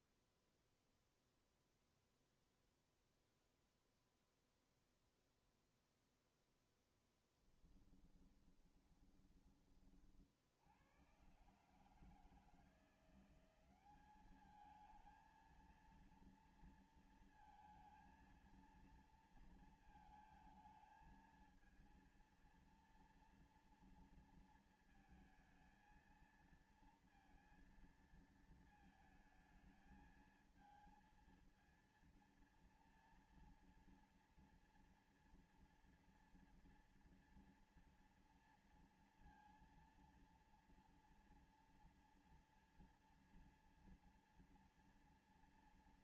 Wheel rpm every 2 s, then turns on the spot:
0, 0, 0, 0, 10, 40, 120, 180, 220, 230, 230, 230, 230, 230, 230, 220, 230, 240, 230, 230, 230, 230, 230.
8-10